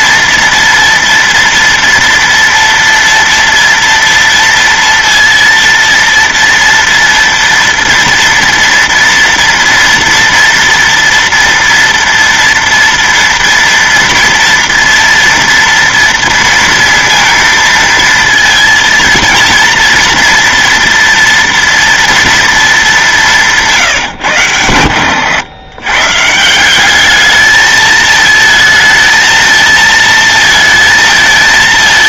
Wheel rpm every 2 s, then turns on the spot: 240, 230, 230, 230, 230, 230, 230, 230, 230, 230, 230, 220, 110, 180, 220, 220.
none